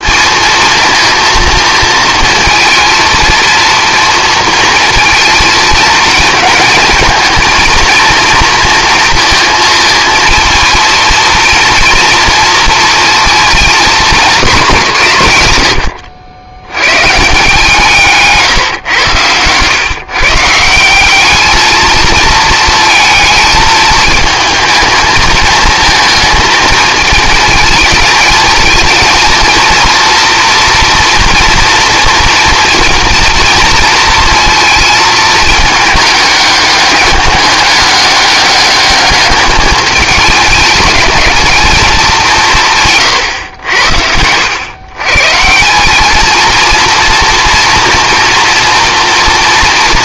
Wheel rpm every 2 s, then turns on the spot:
230, 230, 220, 220, 230, 230, 230, 180, 110, 120, 170, 220, 220, 220, 230, 230, 230, 220, 200, 200, 220, 140, 120, 230, 230.
none